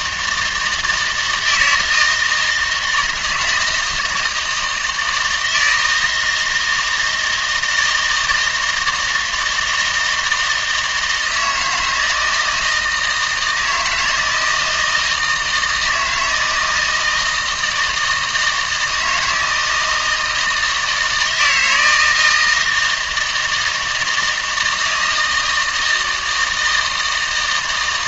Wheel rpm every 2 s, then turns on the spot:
160, 170, 160, 160, 160, 160, 160, 160, 160, 160, 160, 160, 160, 160.
none